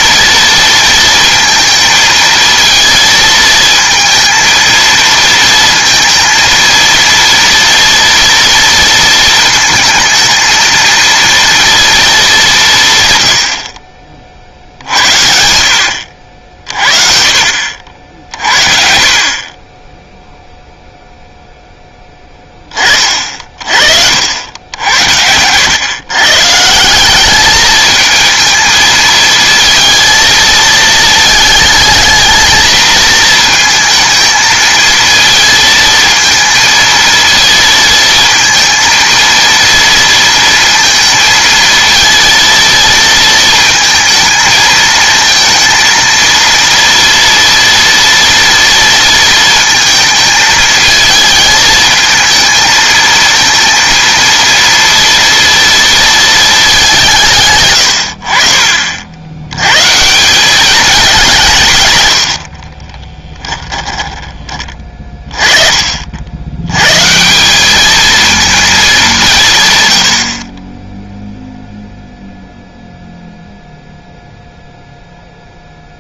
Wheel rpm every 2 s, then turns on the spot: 230, 230, 230, 230, 230, 220, 170, 60, 40, 50, 0, 30, 80, 170, 230, 220, 220, 220, 230, 230, 230, 230, 220, 230, 230, 220, 220, 230, 210, 60, 190, 30, 30, 110, 220, 20, 0, 0.
62-64